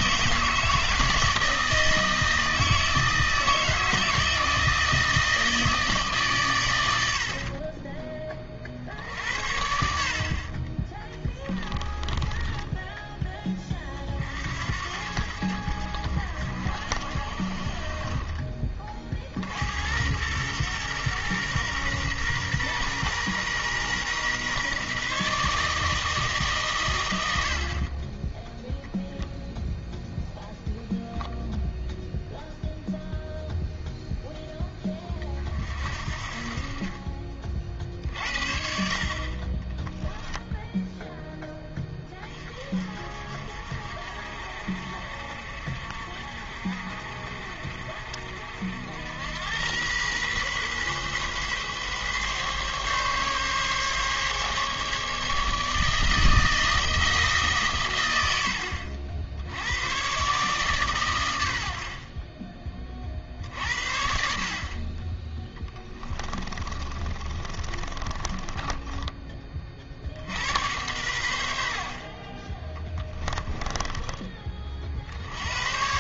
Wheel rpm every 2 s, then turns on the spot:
160, 160, 160, 90, 50, 20, 10, 70, 60, 30, 120, 120, 140, 140, 0, 0, 0, 10, 40, 60, 0, 30, 60, 50, 60, 130, 140, 140, 160, 80, 140, 30, 50, 30, 20, 80, 30, 30.
12-14 66-70 72-74